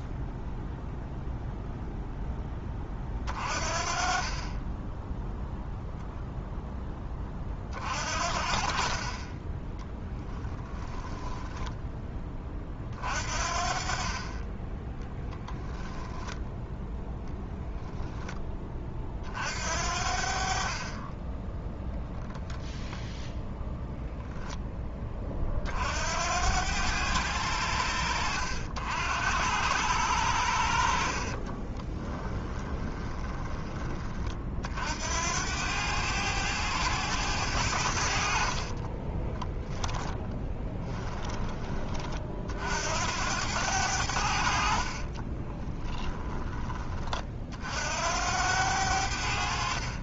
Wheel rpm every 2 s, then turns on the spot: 0, 20, 10, 10, 40, 10, 40, 10, 0, 30, 30, 0, 20, 90, 70, 50, 20, 70, 100, 30, 10, 70, 40, 30, 90.
10-12 14-16 32-34 38-42 44-46